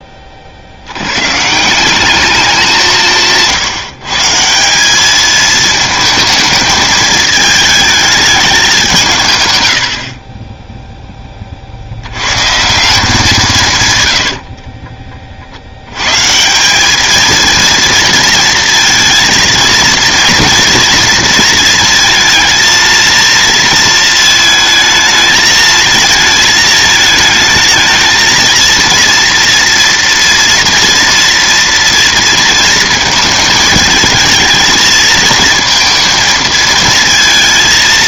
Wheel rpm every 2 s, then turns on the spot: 60, 180, 180, 220, 190, 10, 150, 50, 180, 230, 230, 230, 220, 220, 230, 230, 220, 230, 220.
14-16